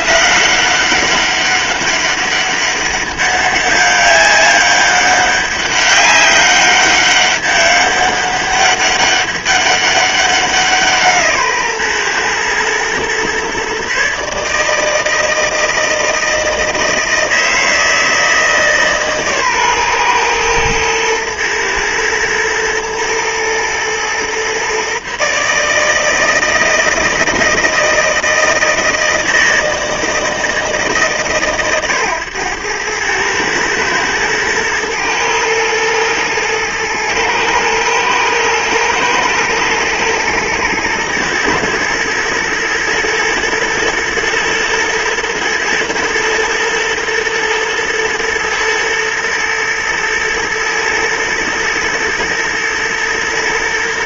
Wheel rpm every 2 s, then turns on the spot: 190, 200, 200, 200, 200, 170, 120, 160, 160, 150, 120, 110, 140, 160, 160, 150, 110, 110, 110, 120, 110, 110, 120, 110, 110, 110, 120.
none